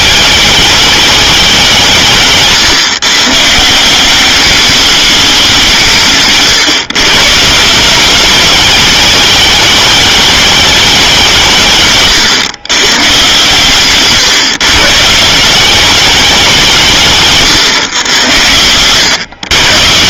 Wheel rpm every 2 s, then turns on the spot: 210, 140, 200, 130, 210, 190, 120, 140, 160, 110.
none